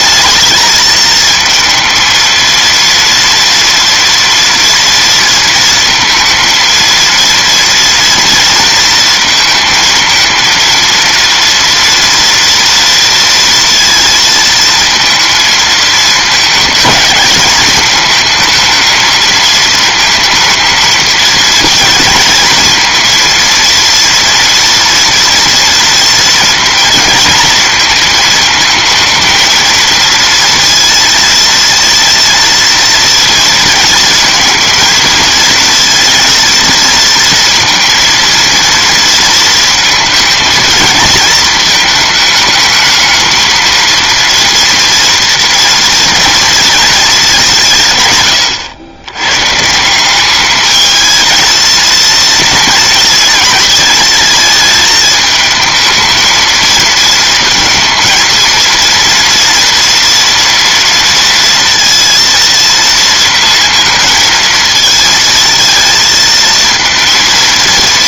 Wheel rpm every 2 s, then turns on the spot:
220, 230, 230, 230, 230, 230, 230, 230, 220, 220, 230, 230, 230, 230, 220, 230, 230, 220, 230, 230, 220, 220, 230, 230, 100, 210, 230, 220, 230, 230, 230, 230, 230, 230.
none